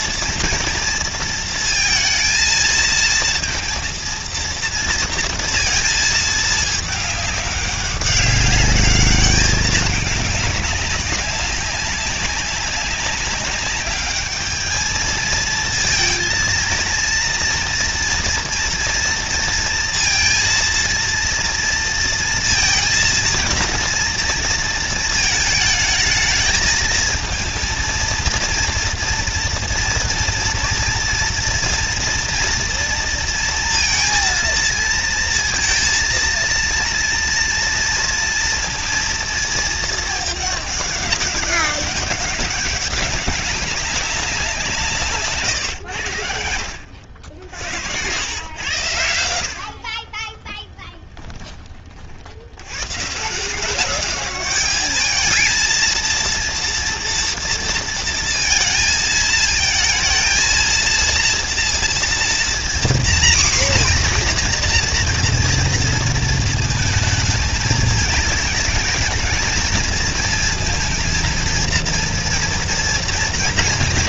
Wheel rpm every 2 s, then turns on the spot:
230, 230, 230, 210, 200, 200, 200, 220, 230, 230, 230, 230, 230, 220, 230, 230, 230, 230, 230, 230, 200, 200, 160, 70, 90, 10, 120, 210, 230, 220, 230, 240, 240, 220, 220, 230, 230.
50-52